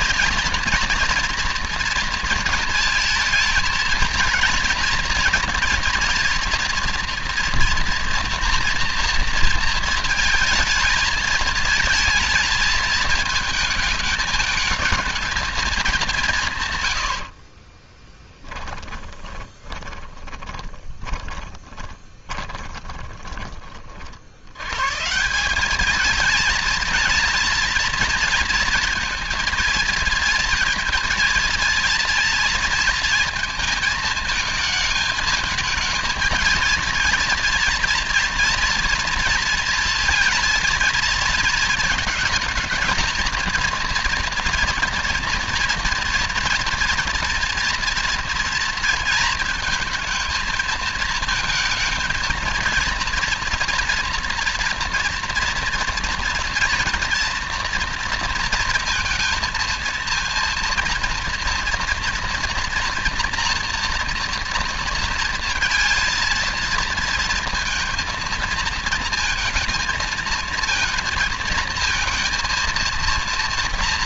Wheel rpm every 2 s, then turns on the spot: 230, 230, 240, 230, 230, 220, 220, 220, 110, 20, 20, 30, 130, 230, 230, 230, 230, 220, 220, 230, 230, 220, 230, 230, 230, 230, 230, 230, 230, 230, 230, 240, 230, 230, 230, 220, 230.
16-24